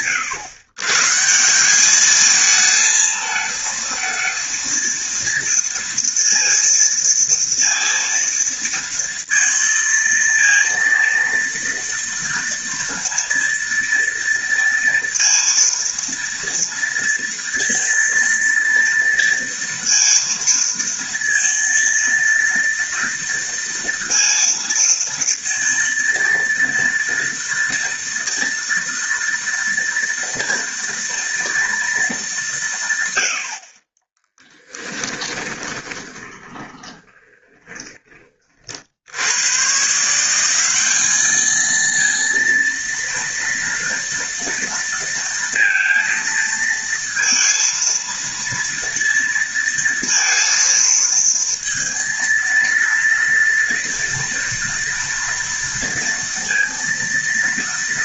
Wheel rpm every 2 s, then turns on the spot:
130, 220, 230, 230, 230, 230, 230, 230, 230, 230, 230, 230, 230, 230, 230, 230, 140, 10, 20, 50, 190, 230, 230, 230, 230, 230, 230, 230, 230.
34-38